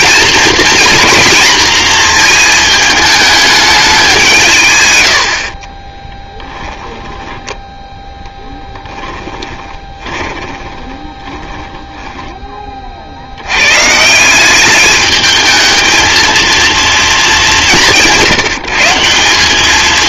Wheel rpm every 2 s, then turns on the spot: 240, 220, 140, 10, 10, 20, 30, 200, 230, 160.
6-12